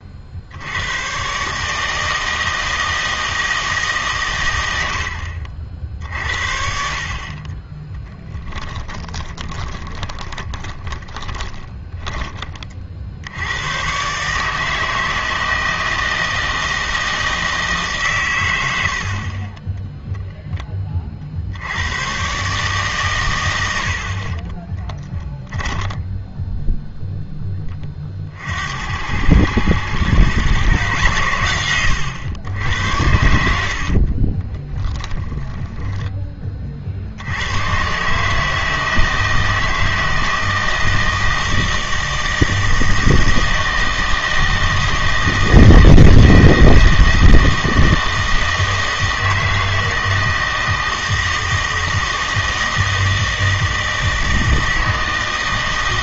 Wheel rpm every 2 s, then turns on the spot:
100, 160, 100, 60, 20, 20, 30, 160, 160, 70, 20, 140, 10, 0, 80, 120, 80, 20, 40, 160, 160, 160, 160, 160, 160, 160, 160, 160.
8-12 24-26 34-36